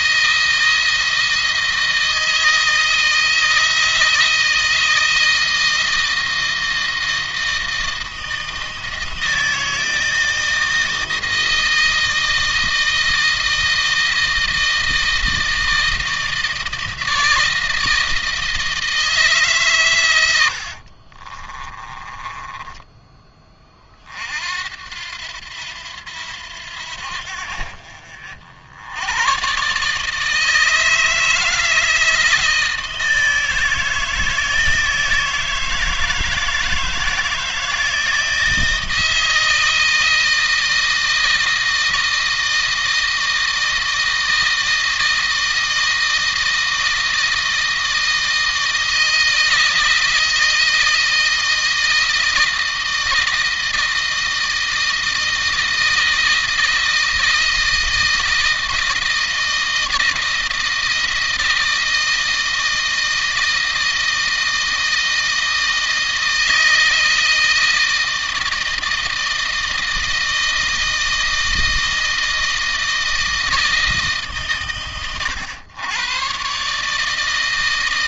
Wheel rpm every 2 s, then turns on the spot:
160, 160, 160, 160, 160, 160, 160, 160, 160, 160, 50, 10, 80, 80, 90, 160, 160, 160, 160, 160, 160, 160, 160, 160, 160, 160, 160, 160, 160, 160, 160, 160, 160, 160, 160, 160, 160, 120, 140.
20-22